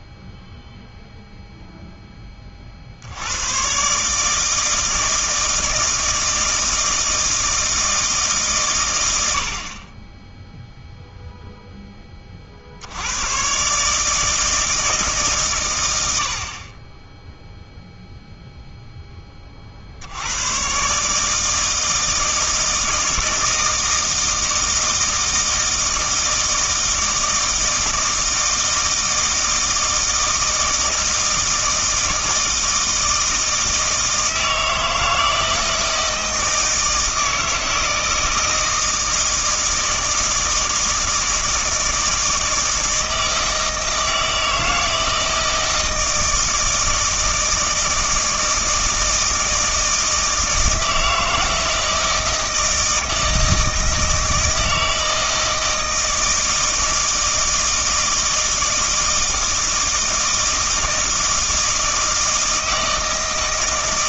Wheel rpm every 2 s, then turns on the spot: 0, 50, 160, 160, 130, 0, 50, 160, 30, 0, 120, 160, 160, 160, 160, 160, 160, 160, 160, 160, 160, 160, 160, 160, 160, 160, 160, 160, 160, 160, 160, 160.
none